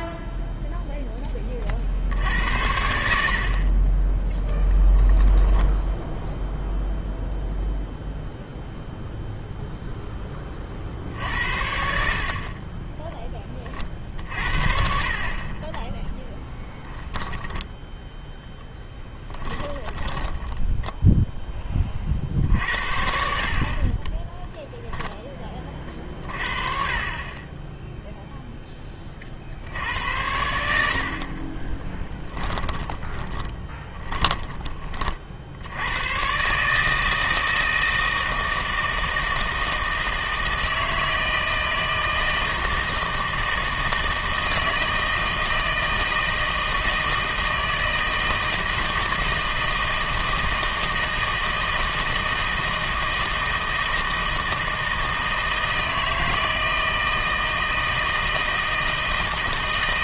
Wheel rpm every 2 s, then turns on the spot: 0, 80, 10, 0, 0, 40, 20, 60, 10, 10, 10, 60, 0, 30, 0, 80, 10, 20, 150, 160, 160, 160, 160, 160, 160, 160, 160, 160, 160, 160.
4-6 16-22 32-34